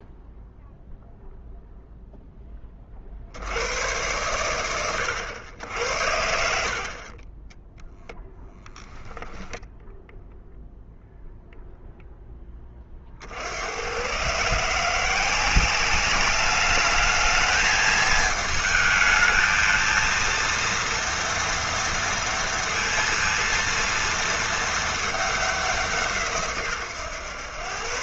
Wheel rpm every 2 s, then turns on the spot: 0, 70, 90, 30, 0, 0, 50, 180, 220, 220, 230, 230, 210, 130.
6-8